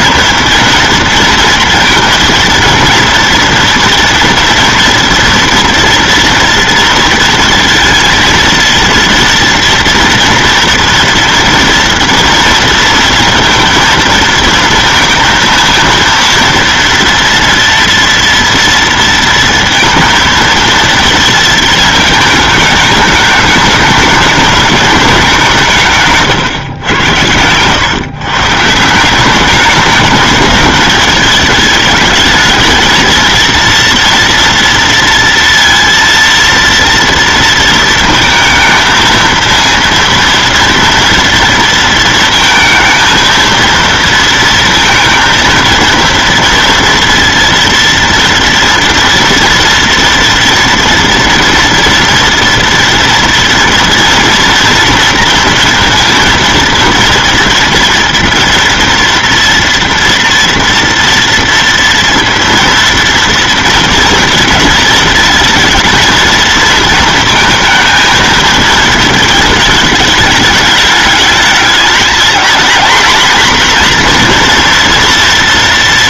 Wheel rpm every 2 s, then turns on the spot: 230, 230, 230, 230, 230, 230, 230, 230, 230, 230, 230, 210, 210, 120, 160, 210, 220, 230, 230, 220, 230, 220, 230, 230, 230, 230, 230, 230, 230, 230, 230, 230, 220, 220, 220, 210, 230, 240.
none